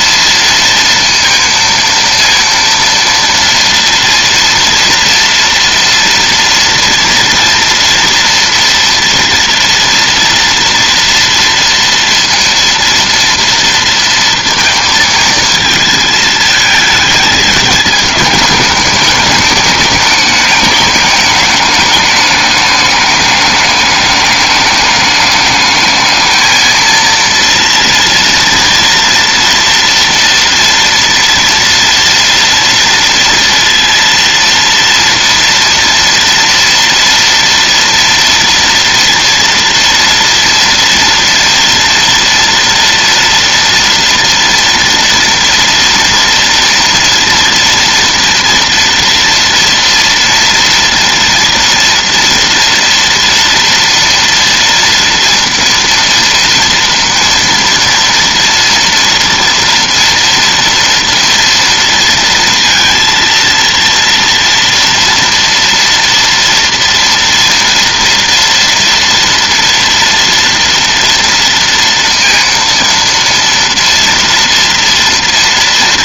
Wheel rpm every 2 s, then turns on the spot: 230, 230, 230, 230, 230, 230, 230, 230, 220, 210, 210, 210, 210, 230, 230, 230, 230, 230, 230, 230, 230, 230, 230, 230, 230, 240, 230, 230, 230, 230, 230, 230, 230, 230, 230, 230, 230, 230.
none